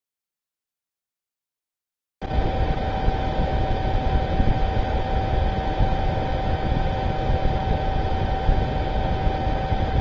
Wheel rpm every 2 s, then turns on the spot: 0, 0, 0, 0, 0.
none